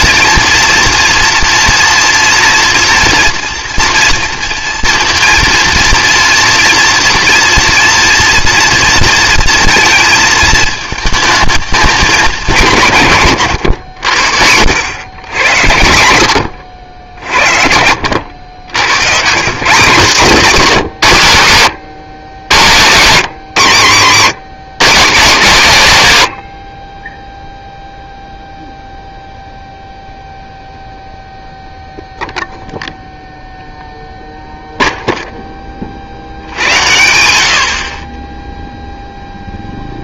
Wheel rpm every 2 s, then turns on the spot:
230, 230, 230, 230, 230, 220, 170, 80, 80, 80, 190, 140, 190, 80, 0, 0, 0, 0, 90, 10.
none